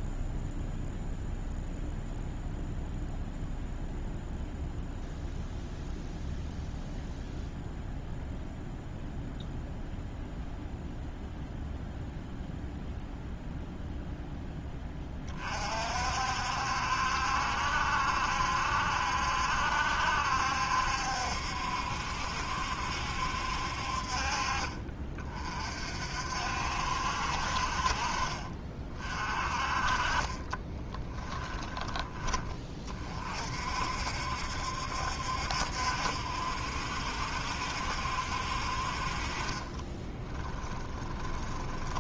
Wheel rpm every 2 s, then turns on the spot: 0, 0, 0, 0, 0, 0, 0, 20, 70, 70, 70, 70, 40, 60, 40, 20, 30, 70, 70, 50, 20.
30-32 40-42